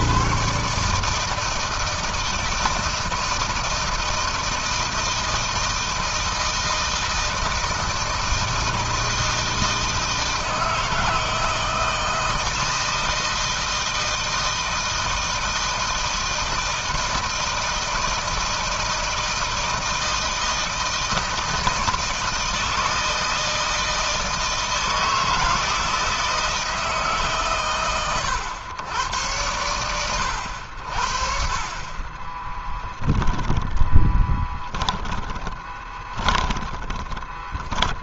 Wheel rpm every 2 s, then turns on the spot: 160, 160, 160, 160, 160, 160, 160, 160, 160, 160, 160, 160, 160, 150, 120, 60, 10, 10, 20.
32-36